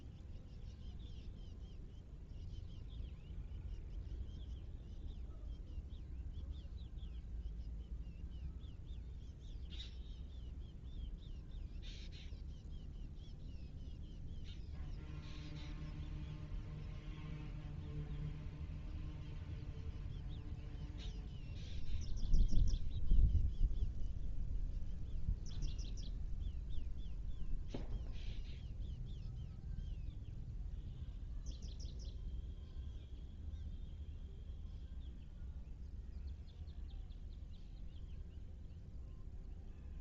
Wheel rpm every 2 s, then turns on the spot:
0, 0, 0, 0, 0, 0, 0, 0, 0, 0, 0, 0, 0, 0, 0, 0, 0, 0, 0, 0.
none